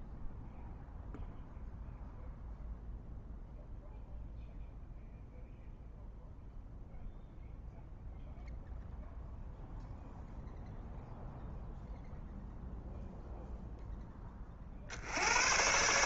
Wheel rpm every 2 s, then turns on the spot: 0, 0, 0, 0, 0, 0, 0, 60.
none